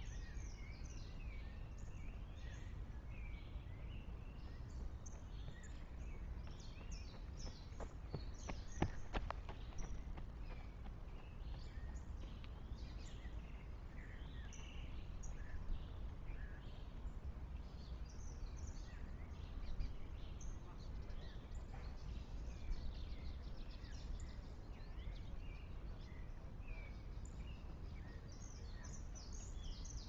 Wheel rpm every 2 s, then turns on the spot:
0, 0, 0, 0, 0, 0, 0, 0, 0, 0, 0, 0, 0, 0, 0.
none